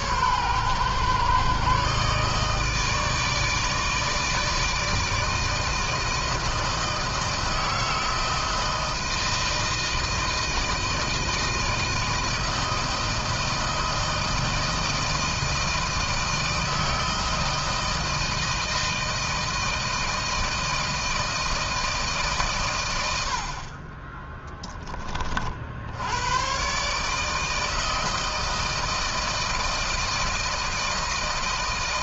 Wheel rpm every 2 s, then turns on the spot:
130, 140, 160, 160, 160, 160, 160, 160, 160, 160, 160, 160, 30, 80, 160, 160.
none